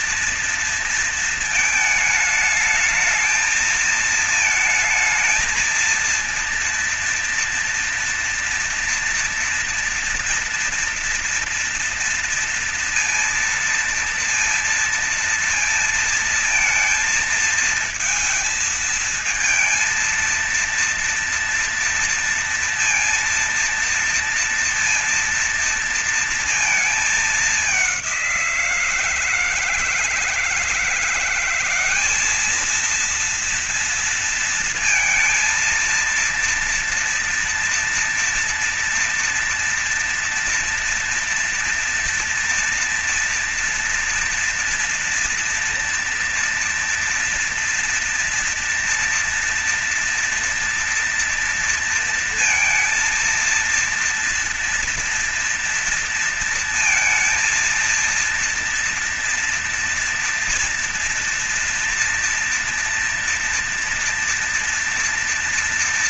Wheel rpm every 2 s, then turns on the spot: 230, 220, 220, 230, 230, 230, 230, 230, 220, 230, 230, 230, 230, 220, 170, 170, 220, 230, 230, 230, 230, 230, 230, 240, 230, 230, 230, 230, 230, 230, 240, 230, 230.
none